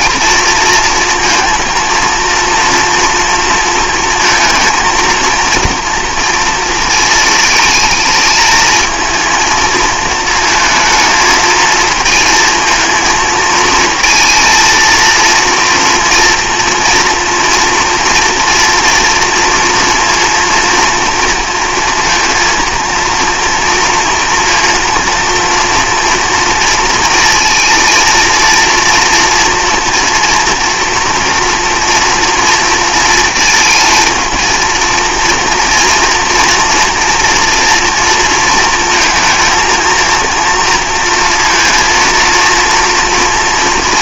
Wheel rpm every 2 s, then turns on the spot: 230, 240, 230, 230, 220, 220, 230, 230, 230, 230, 230, 230, 230, 230, 230, 230, 230, 230, 230, 230, 240, 230.
none